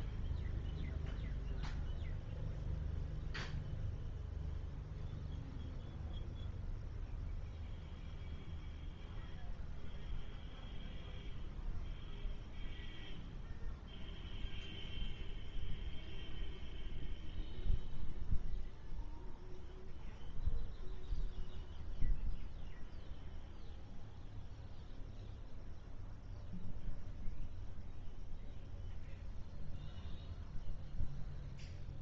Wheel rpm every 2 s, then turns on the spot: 0, 0, 0, 0, 0, 0, 0, 0, 0, 0, 0, 0, 0, 0, 0, 0.
none